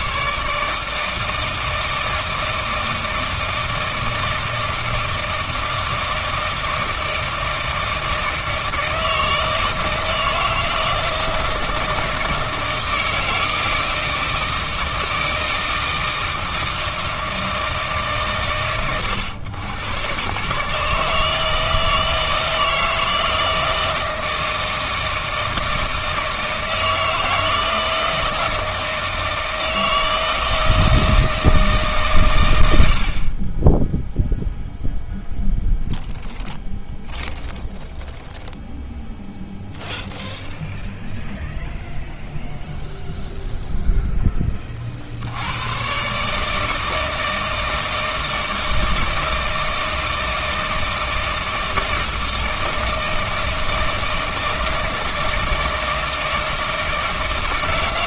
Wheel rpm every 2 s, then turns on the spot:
150, 160, 160, 160, 160, 160, 160, 160, 160, 120, 140, 160, 160, 160, 160, 160, 100, 0, 0, 0, 0, 0, 30, 160, 160, 160, 160, 160, 160.
none